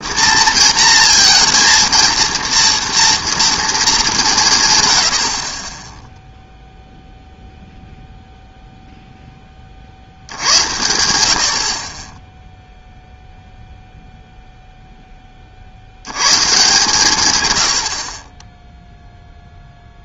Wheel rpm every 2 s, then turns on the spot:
230, 230, 120, 0, 0, 80, 0, 0, 140, 10.
none